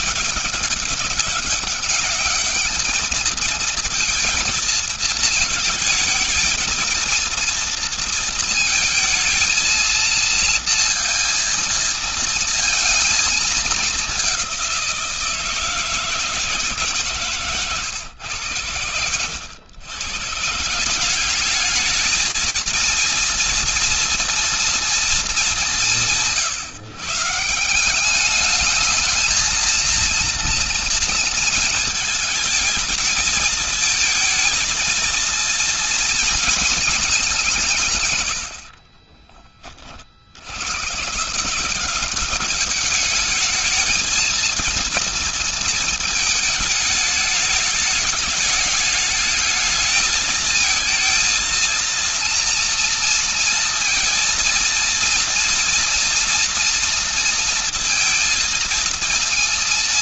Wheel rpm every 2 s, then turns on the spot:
200, 210, 230, 230, 230, 230, 230, 180, 150, 100, 170, 230, 230, 160, 220, 230, 220, 230, 220, 40, 110, 210, 230, 220, 210, 220, 230, 230, 230, 220.
none